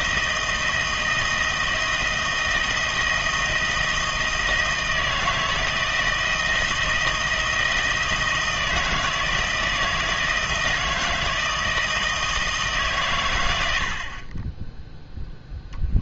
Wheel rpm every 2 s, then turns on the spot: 160, 170, 160, 170, 160, 160, 150, 10.
none